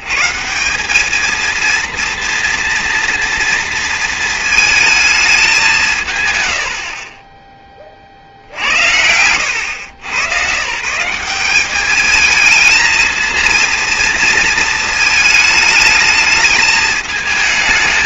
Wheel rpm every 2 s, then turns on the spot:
160, 230, 220, 120, 60, 130, 220, 230, 210.
none